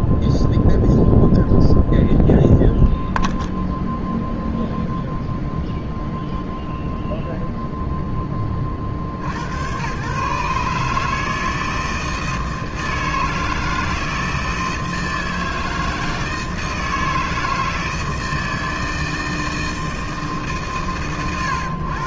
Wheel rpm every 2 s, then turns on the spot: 0, 0, 0, 0, 60, 150, 160, 160, 160, 160, 100.
none